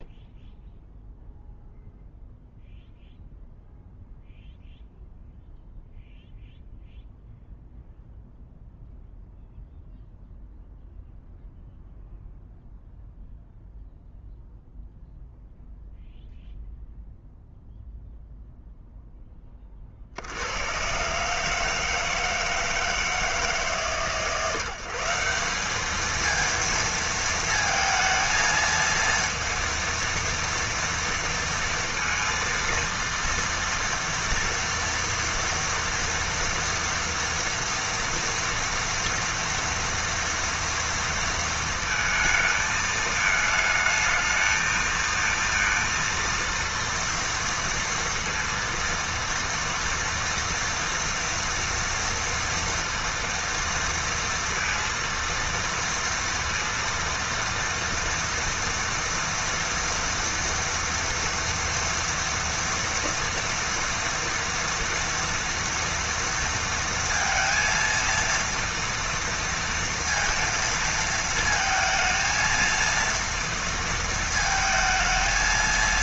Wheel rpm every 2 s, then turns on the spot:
0, 0, 0, 0, 0, 0, 0, 0, 0, 0, 110, 160, 160, 220, 230, 230, 230, 230, 230, 230, 230, 220, 220, 230, 230, 230, 230, 230, 230, 230, 230, 230, 230, 230, 230, 230, 230, 220.
none